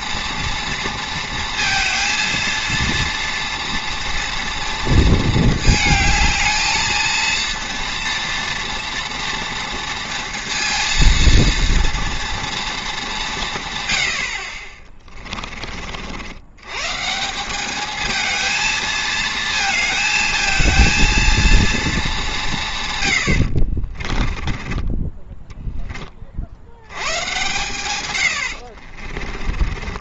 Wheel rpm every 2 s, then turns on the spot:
230, 230, 230, 220, 230, 230, 230, 40, 120, 220, 230, 150, 20, 80, 60.
24-26 28-30